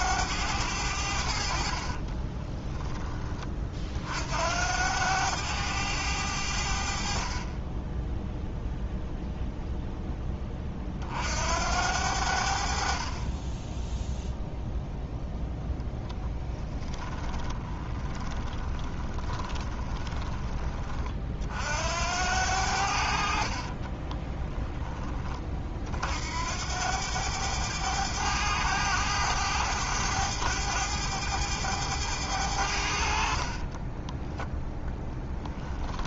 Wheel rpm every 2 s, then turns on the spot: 80, 10, 90, 50, 0, 40, 40, 0, 10, 20, 30, 60, 20, 90, 100, 100, 60, 10.
16-20 24-26 34-36